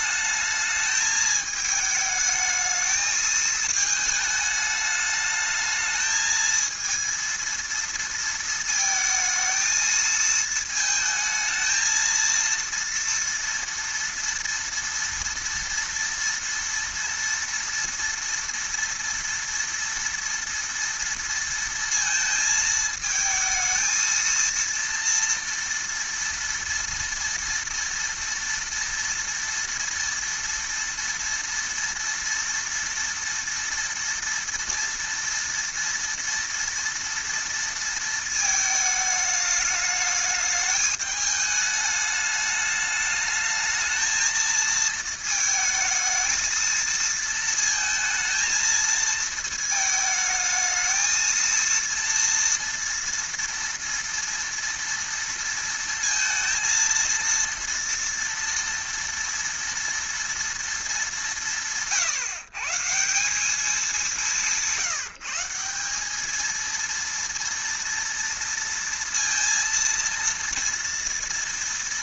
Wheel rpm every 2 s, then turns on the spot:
210, 220, 210, 220, 230, 220, 230, 230, 230, 230, 230, 220, 230, 230, 230, 230, 230, 230, 230, 220, 210, 210, 220, 220, 230, 220, 230, 230, 230, 230, 230, 140, 170, 220, 230, 230.
none